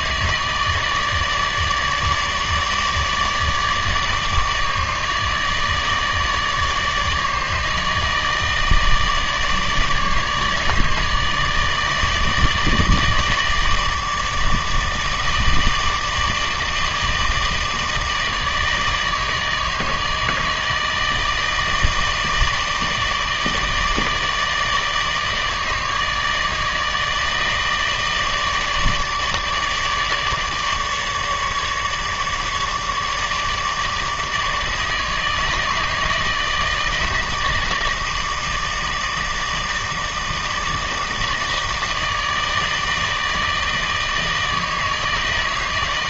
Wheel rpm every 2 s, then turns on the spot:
160, 150, 150, 150, 160, 150, 150, 160, 160, 160, 160, 160, 160, 150, 150, 150, 150, 160, 160, 160, 160, 160, 160.
none